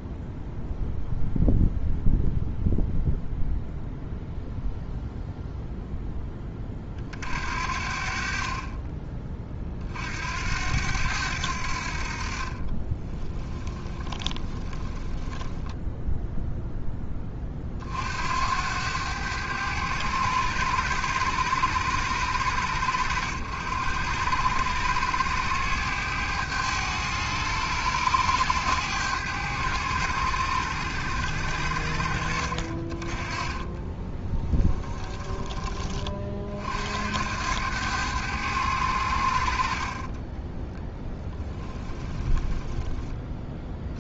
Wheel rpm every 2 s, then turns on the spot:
0, 0, 0, 40, 20, 90, 20, 20, 10, 90, 100, 90, 100, 100, 100, 80, 30, 10, 70, 90, 0, 10.
12-16 34-36 42-44